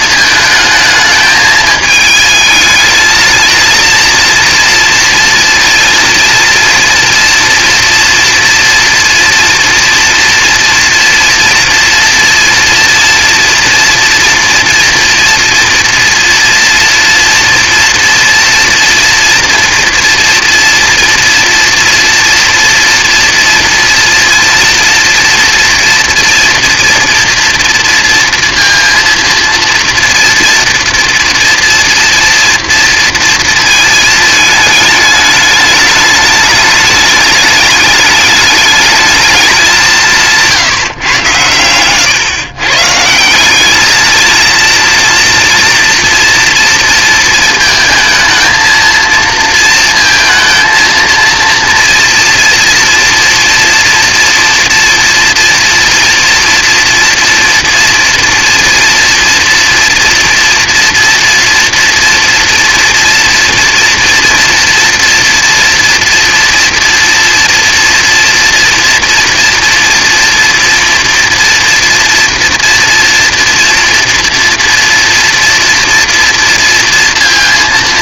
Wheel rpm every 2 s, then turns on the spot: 220, 220, 230, 230, 230, 230, 230, 230, 230, 230, 230, 240, 230, 230, 230, 240, 240, 220, 210, 210, 160, 130, 230, 230, 220, 230, 230, 230, 230, 230, 230, 230, 230, 230, 240, 230, 230, 230, 230.
none